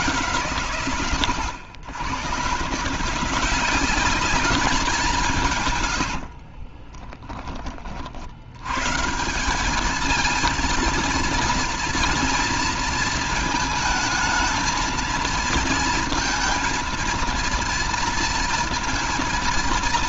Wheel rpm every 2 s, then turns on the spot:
130, 140, 200, 30, 90, 230, 230, 220, 230, 230.
6-8